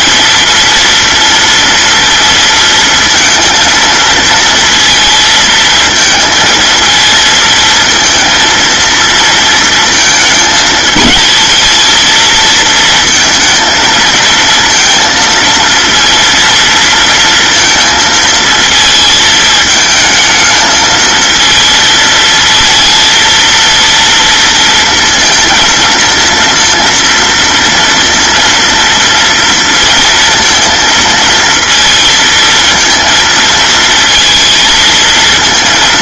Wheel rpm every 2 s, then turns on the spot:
230, 230, 230, 230, 230, 220, 230, 230, 230, 220, 220, 230, 230, 230, 230, 230, 220, 230.
none